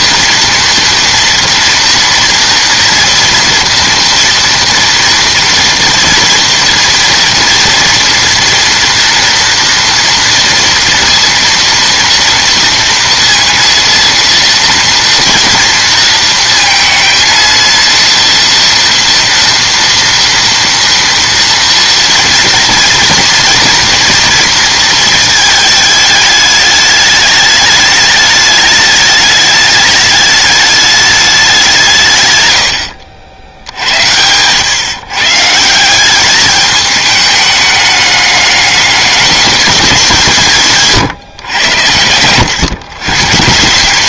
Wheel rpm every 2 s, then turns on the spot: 240, 230, 230, 230, 240, 230, 230, 230, 230, 230, 230, 230, 230, 210, 210, 210, 90, 130, 210, 200, 160, 130.
none